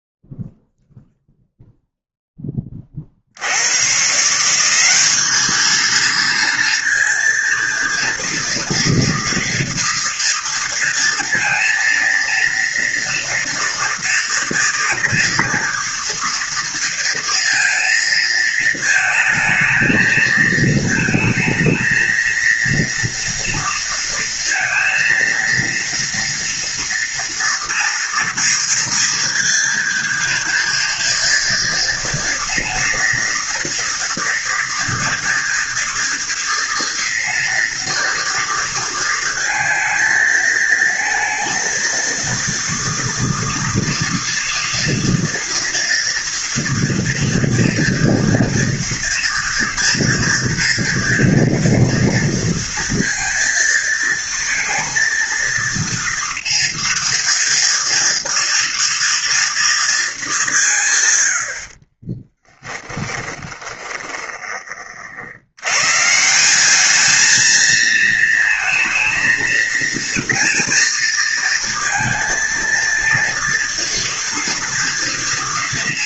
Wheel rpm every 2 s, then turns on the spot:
0, 70, 210, 230, 240, 230, 230, 230, 230, 220, 220, 230, 230, 230, 230, 230, 230, 230, 230, 230, 230, 230, 230, 230, 230, 230, 230, 230, 230, 230, 100, 10, 70, 220, 230, 230, 230, 240.
62-64